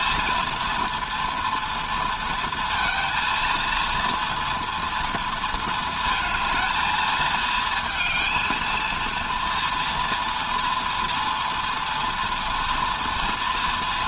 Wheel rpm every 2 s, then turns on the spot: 240, 230, 230, 220, 230, 230, 230.
none